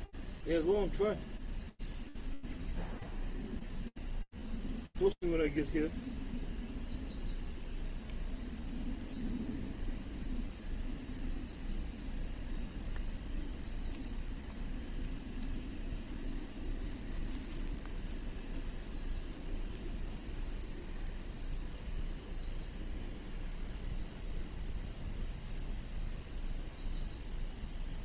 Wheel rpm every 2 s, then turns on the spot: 0, 0, 0, 0, 0, 0, 0, 0, 0, 0, 0, 0, 0, 0.
none